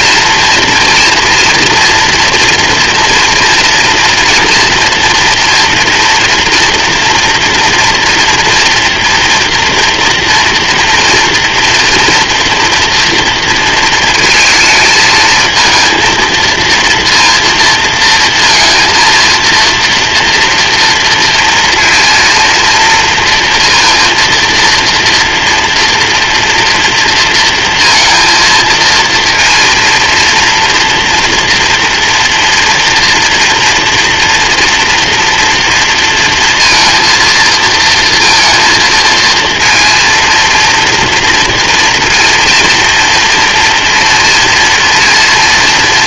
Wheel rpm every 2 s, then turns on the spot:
240, 230, 230, 240, 240, 230, 230, 220, 230, 230, 230, 230, 230, 230, 230, 230, 230, 230, 230, 230, 230, 230, 230.
none